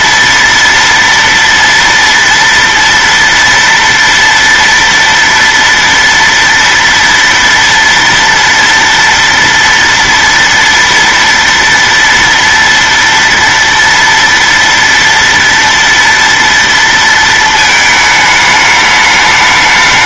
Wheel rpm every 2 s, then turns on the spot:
230, 230, 230, 230, 230, 240, 230, 230, 230, 210.
none